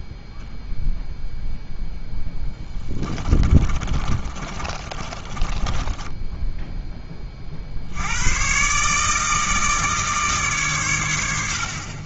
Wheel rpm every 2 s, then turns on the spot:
0, 10, 30, 10, 130, 130.
2-6